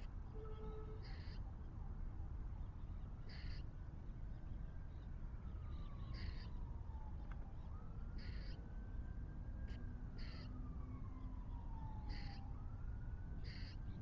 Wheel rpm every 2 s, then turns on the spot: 0, 0, 0, 0, 0, 0, 0.
none